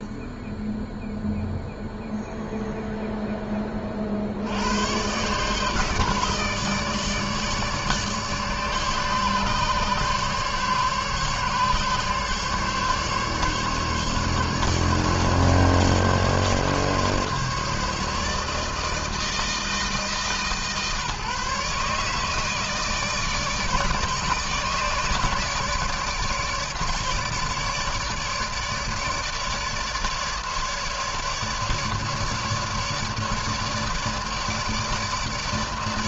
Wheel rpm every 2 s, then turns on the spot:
0, 0, 70, 150, 150, 140, 140, 140, 140, 150, 140, 150, 150, 150, 150, 150, 150, 150.
none